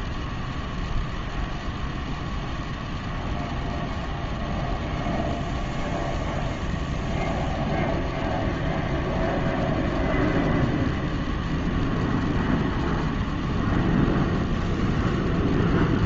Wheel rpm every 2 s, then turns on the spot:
0, 0, 0, 0, 0, 0, 0, 0.
none